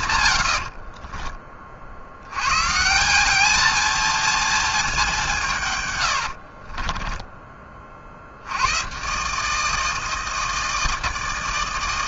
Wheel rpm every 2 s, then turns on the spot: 160, 60, 220, 120, 40, 160.
none